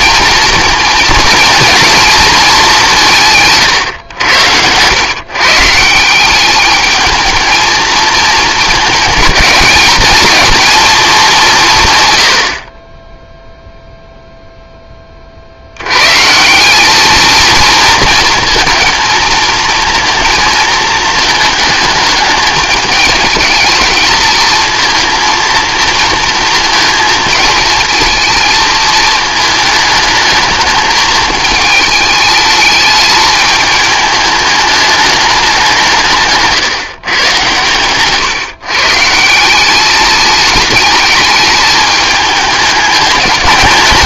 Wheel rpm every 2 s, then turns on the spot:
230, 220, 90, 200, 220, 220, 50, 10, 180, 220, 220, 210, 230, 230, 220, 220, 210, 210, 150, 140, 210, 210.
none